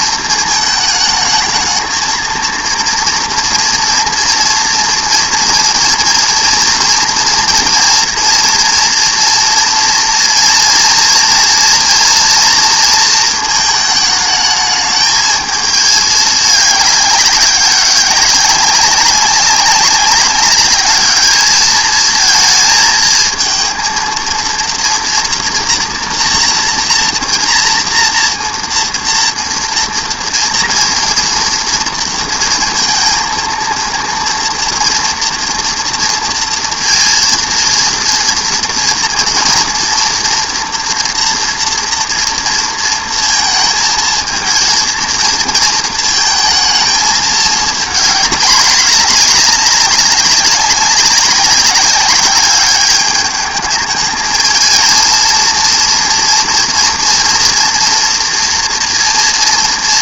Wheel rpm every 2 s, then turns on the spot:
220, 230, 230, 230, 240, 240, 230, 220, 210, 190, 200, 230, 230, 230, 230, 230, 230, 230, 230, 240, 230, 240, 230, 220, 210, 190, 200, 220, 230, 240.
none